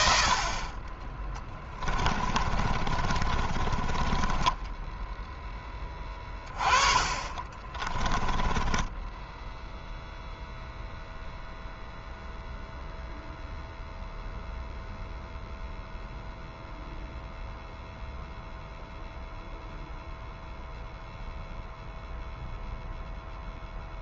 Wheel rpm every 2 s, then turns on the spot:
40, 30, 10, 30, 10, 0, 0, 0, 0, 0, 0, 0.
2-10